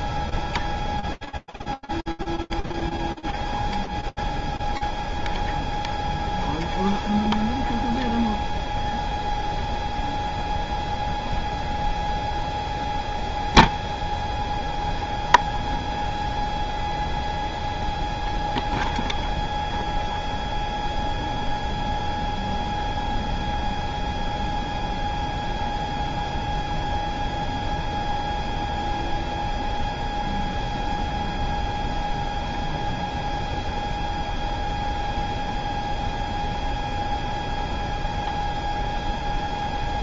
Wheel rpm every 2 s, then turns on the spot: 0, 0, 0, 0, 0, 0, 0, 0, 0, 0, 0, 0, 0, 0, 0, 0, 0, 0, 0, 0.
none